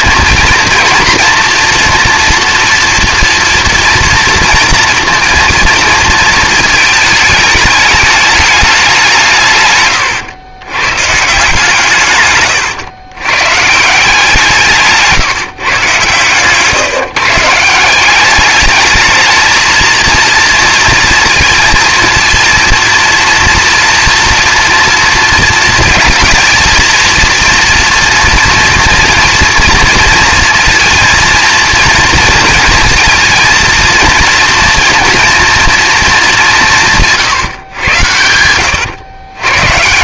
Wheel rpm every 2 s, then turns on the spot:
230, 230, 230, 220, 200, 120, 120, 160, 160, 210, 230, 230, 230, 230, 230, 230, 230, 230, 180, 90.
12-14 38-40